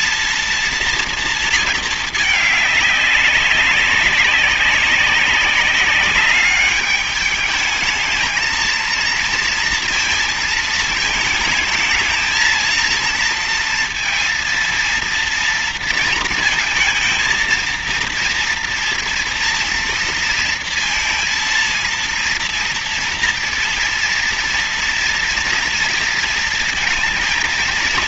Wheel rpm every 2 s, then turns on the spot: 230, 210, 200, 200, 220, 220, 230, 230, 230, 230, 230, 230, 230, 230.
none